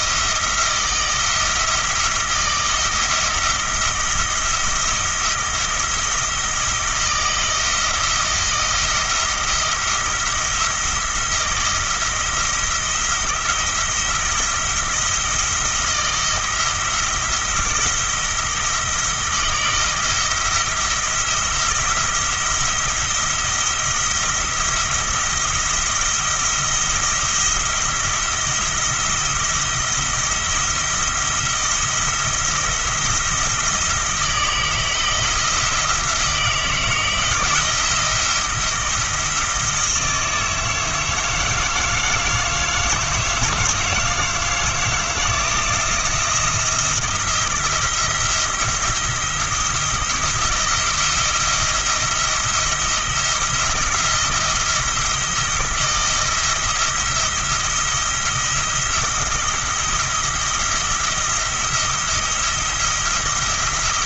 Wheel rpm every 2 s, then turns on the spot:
170, 160, 170, 160, 170, 170, 170, 170, 170, 160, 170, 170, 170, 170, 170, 170, 170, 160, 170, 170, 160, 160, 160, 170, 170, 170, 170, 160, 170, 170, 170, 170.
none